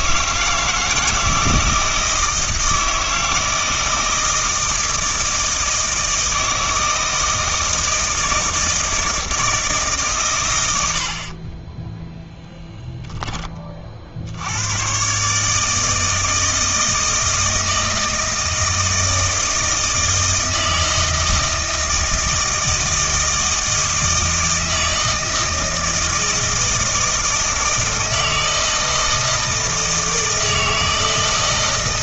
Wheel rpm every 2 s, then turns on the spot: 160, 160, 160, 160, 160, 90, 10, 120, 160, 160, 160, 160, 160, 160, 160, 160.
none